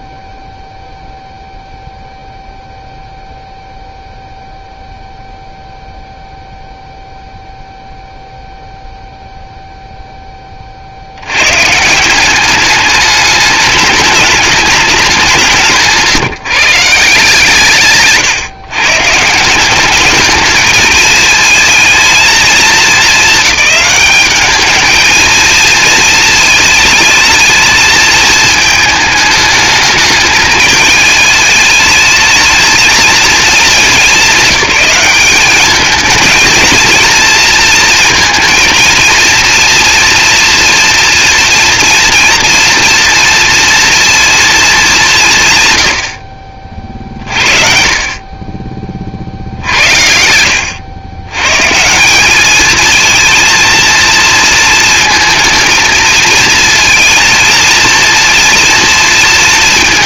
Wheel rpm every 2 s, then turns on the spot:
0, 0, 0, 0, 0, 50, 210, 200, 160, 120, 220, 210, 220, 220, 220, 220, 220, 200, 230, 230, 230, 230, 210, 50, 40, 100, 220, 220, 230, 230.
none